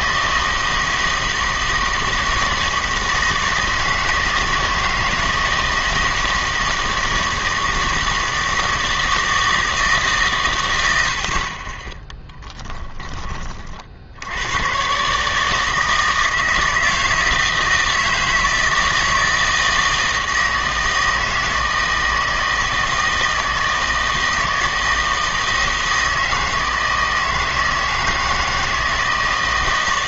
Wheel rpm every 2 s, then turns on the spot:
160, 160, 160, 160, 160, 100, 10, 130, 160, 160, 160, 160, 160, 160, 160.
none